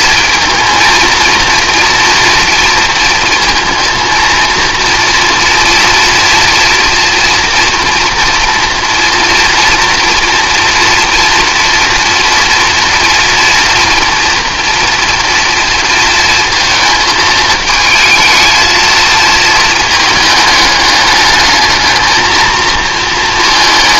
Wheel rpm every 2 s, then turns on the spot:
230, 230, 230, 230, 240, 240, 230, 230, 220, 220, 210, 230.
none